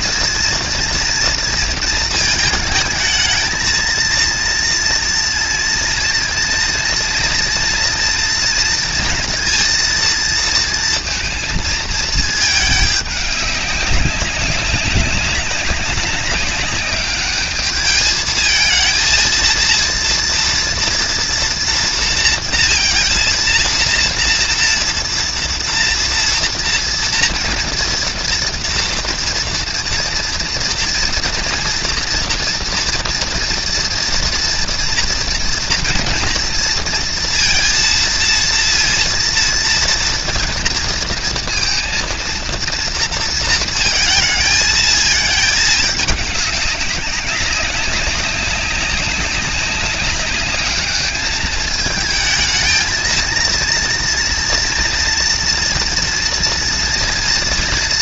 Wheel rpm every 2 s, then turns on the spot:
230, 220, 230, 230, 230, 230, 210, 190, 200, 220, 230, 230, 230, 230, 230, 230, 230, 230, 230, 230, 230, 230, 220, 190, 200, 210, 220, 230, 230.
none